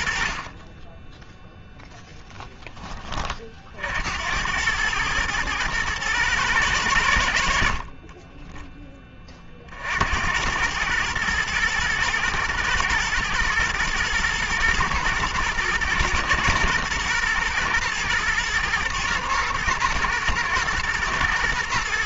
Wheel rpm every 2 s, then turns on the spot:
20, 30, 110, 90, 10, 110, 110, 110, 110, 120, 120.
2-4